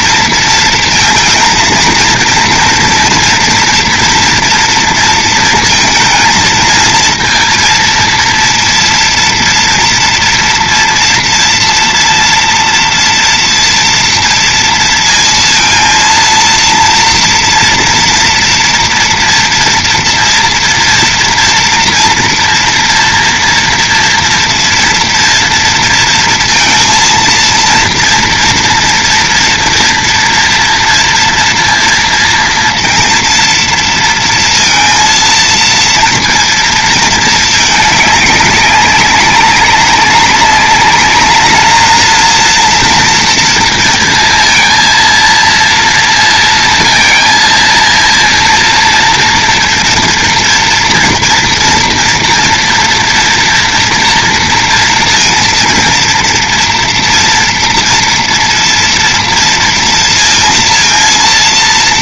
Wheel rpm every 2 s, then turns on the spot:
230, 240, 230, 230, 230, 230, 230, 230, 230, 230, 230, 230, 230, 230, 240, 230, 230, 230, 230, 200, 200, 230, 230, 230, 230, 230, 230, 230, 230, 230, 230.
none